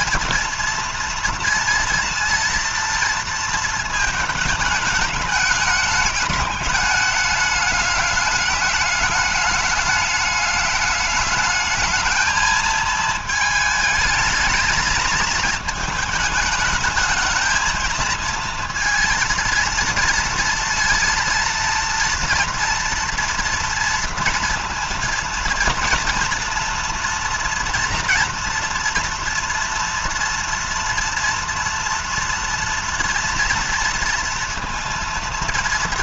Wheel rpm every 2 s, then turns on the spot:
230, 230, 210, 210, 210, 210, 220, 220, 220, 230, 230, 230, 230, 230, 230, 230, 230, 230.
none